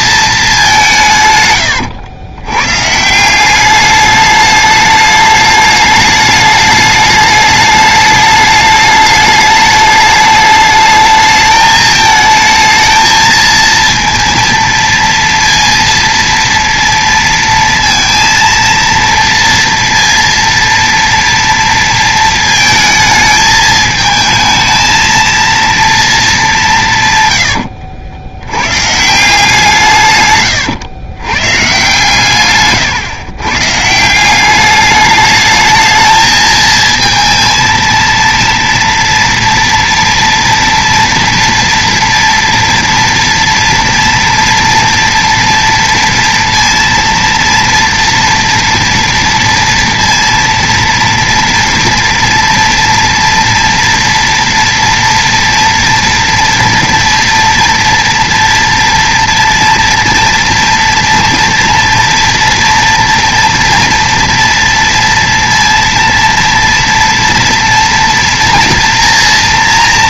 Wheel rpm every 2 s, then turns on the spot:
190, 120, 210, 210, 210, 210, 220, 230, 230, 230, 230, 230, 220, 190, 110, 120, 130, 190, 220, 230, 230, 230, 230, 230, 230, 230, 230, 230, 230, 240, 230, 230, 230, 230, 230.
none